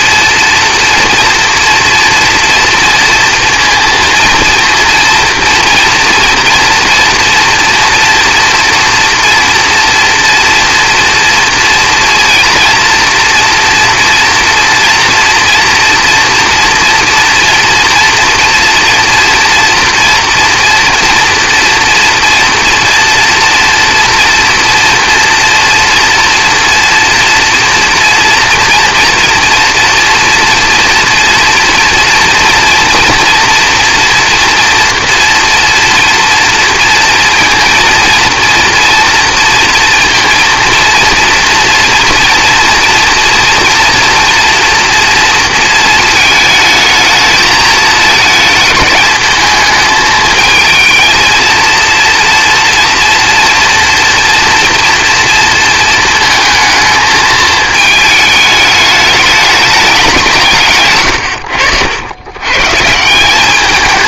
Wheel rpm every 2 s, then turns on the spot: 230, 230, 230, 230, 230, 230, 230, 230, 230, 230, 230, 240, 230, 240, 230, 230, 230, 230, 230, 230, 230, 230, 230, 220, 210, 220, 230, 230, 220, 210, 160, 130.
none